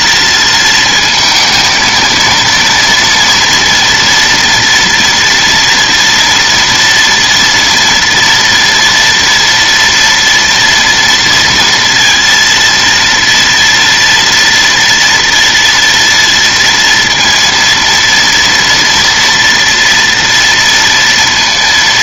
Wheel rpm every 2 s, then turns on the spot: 230, 230, 230, 240, 230, 230, 230, 230, 230, 230, 230.
none